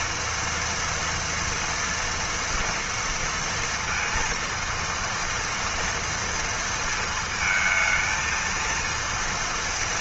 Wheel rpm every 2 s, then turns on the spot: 240, 230, 230, 230, 230.
none